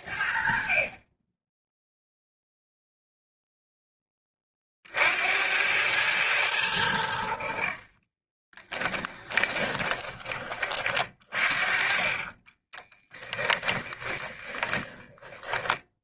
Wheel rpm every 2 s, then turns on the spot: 40, 0, 40, 100, 10, 30, 20, 20.
8-10 12-16